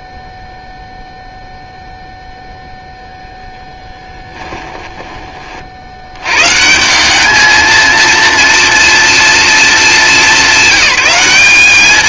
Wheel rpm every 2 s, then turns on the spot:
0, 0, 20, 210, 230, 200.
none